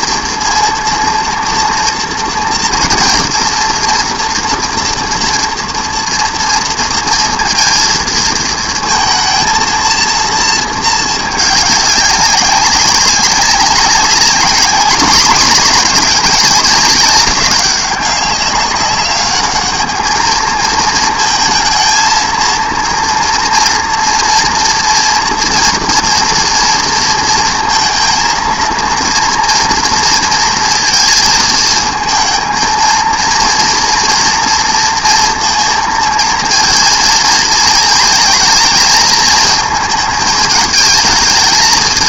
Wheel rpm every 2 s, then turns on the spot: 230, 230, 240, 230, 220, 220, 190, 210, 210, 200, 220, 230, 230, 230, 230, 230, 230, 230, 230, 220, 220.
none